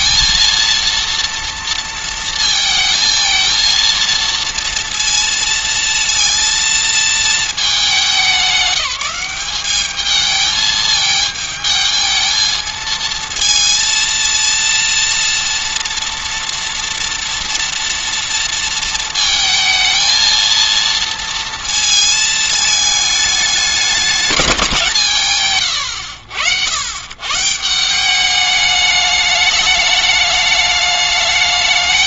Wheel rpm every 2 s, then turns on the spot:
230, 230, 230, 230, 190, 220, 220, 230, 230, 230, 230, 220, 160, 90, 210, 210.
none